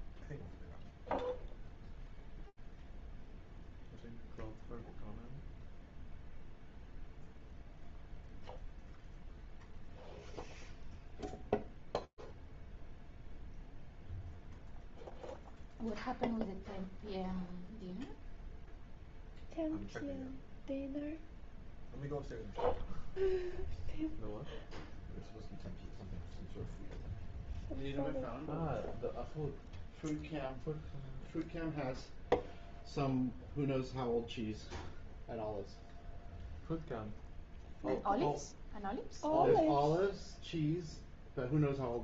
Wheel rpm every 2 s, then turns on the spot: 0, 0, 0, 0, 0, 0, 0, 0, 0, 0, 0, 0, 0, 0, 0, 0, 0, 0, 0, 0, 0.
none